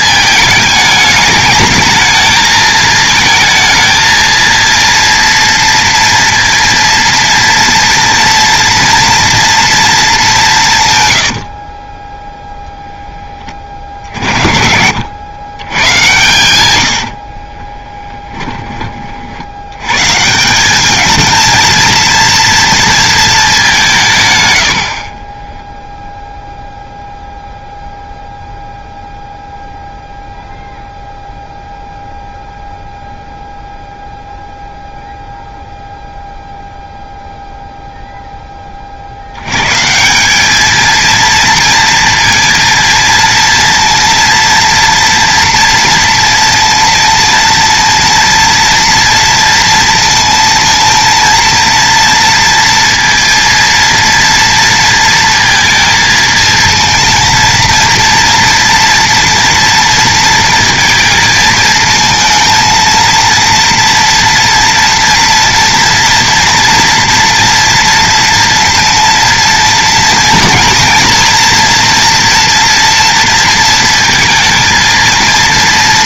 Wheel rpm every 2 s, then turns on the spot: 220, 220, 230, 230, 240, 140, 0, 70, 90, 20, 200, 230, 90, 0, 0, 0, 0, 0, 0, 30, 220, 230, 230, 230, 230, 230, 230, 230, 230, 230, 230, 230, 230, 240, 230, 230, 230, 230.
none